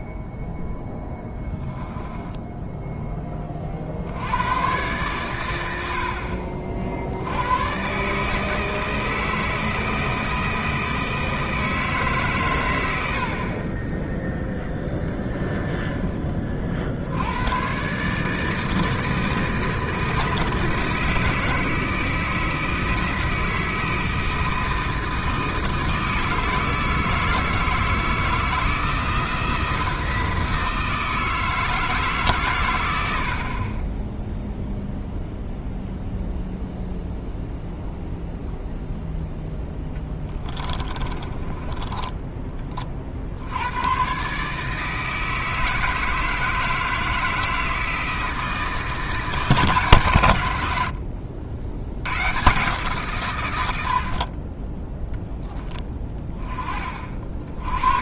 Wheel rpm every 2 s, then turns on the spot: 10, 10, 120, 50, 160, 160, 100, 10, 50, 160, 160, 160, 160, 160, 160, 160, 90, 0, 0, 0, 20, 40, 160, 160, 160, 90, 140, 10, 20.
0-2 14-16 40-42